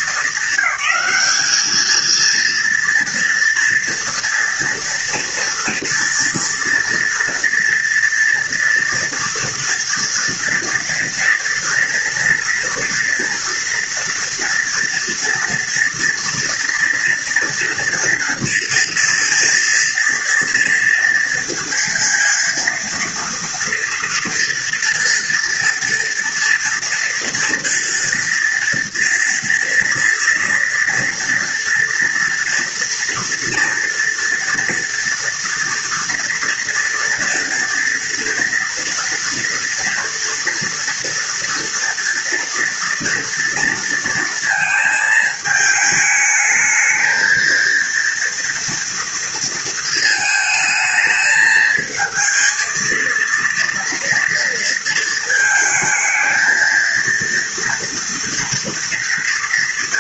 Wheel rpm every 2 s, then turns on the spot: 220, 230, 240, 230, 230, 230, 230, 230, 230, 230, 230, 230, 230, 230, 230, 230, 230, 230, 230, 240, 240, 230, 220, 220, 240, 220, 230, 230, 230, 230.
none